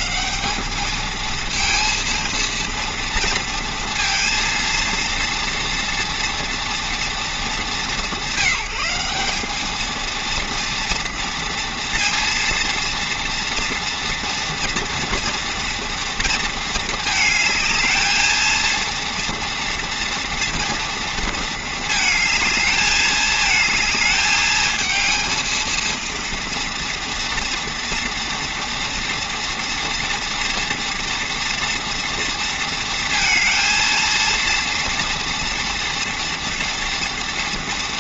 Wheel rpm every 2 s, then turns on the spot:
210, 230, 230, 240, 180, 230, 230, 230, 220, 230, 230, 210, 220, 230, 230, 230, 230, 230, 230.
none